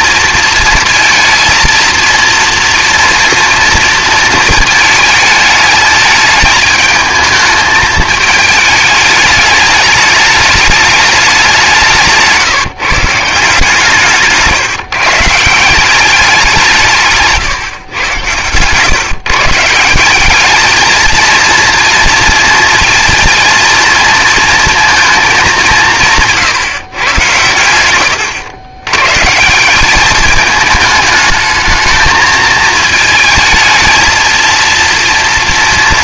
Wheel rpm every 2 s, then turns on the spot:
230, 230, 220, 220, 210, 210, 150, 150, 170, 130, 220, 230, 230, 140, 120, 210, 220, 230.
none